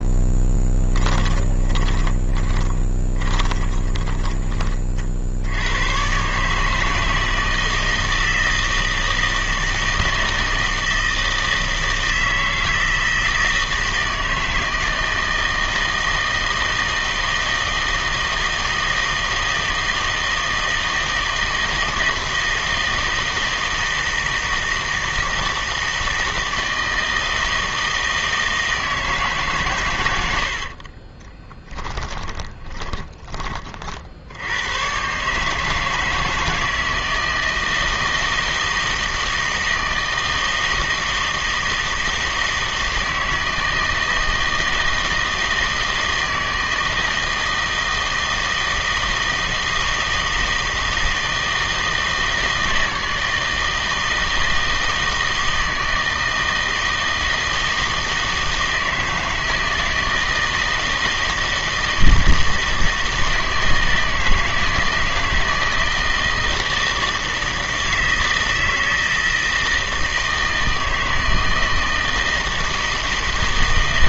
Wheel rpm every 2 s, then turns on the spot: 10, 20, 30, 150, 160, 160, 160, 160, 160, 160, 160, 160, 160, 160, 160, 50, 20, 110, 160, 160, 160, 160, 160, 160, 160, 160, 160, 160, 160, 160, 160, 160, 160, 160, 160, 160, 160.
0-4 30-34